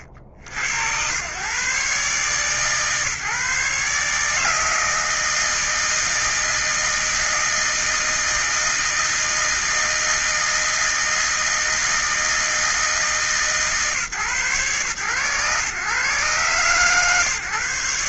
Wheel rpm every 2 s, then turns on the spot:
80, 140, 150, 160, 160, 160, 160, 140, 130.
none